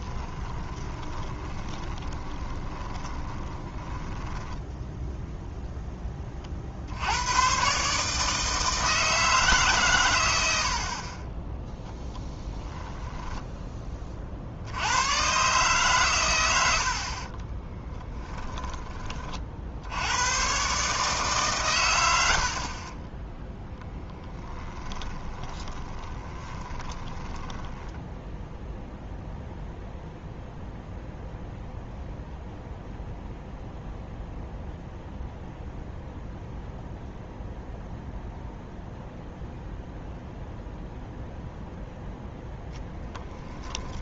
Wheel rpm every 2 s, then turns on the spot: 20, 30, 10, 50, 160, 60, 10, 70, 80, 20, 140, 50, 10, 10, 0, 0, 0, 0, 0, 0, 0, 0.
0-6 12-14 22-28